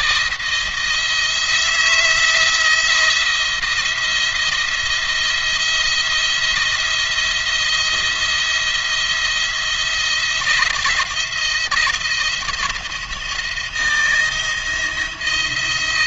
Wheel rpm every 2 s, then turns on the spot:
170, 170, 160, 170, 170, 170, 160, 170.
none